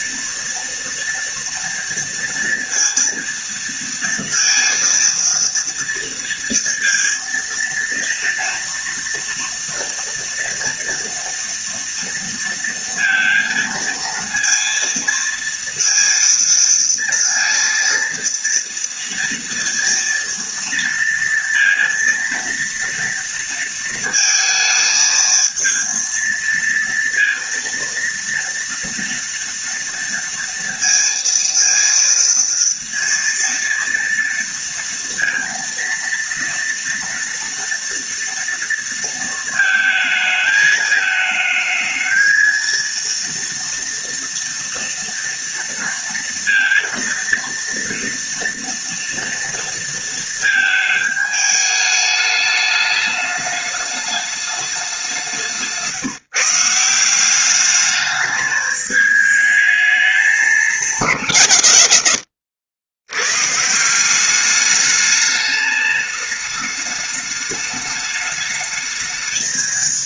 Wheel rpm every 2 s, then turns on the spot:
230, 230, 230, 230, 230, 240, 230, 230, 230, 230, 230, 230, 220, 230, 230, 230, 230, 230, 230, 230, 220, 230, 230, 230, 230, 220, 210, 200, 160, 210, 210, 100, 200, 210, 210.
none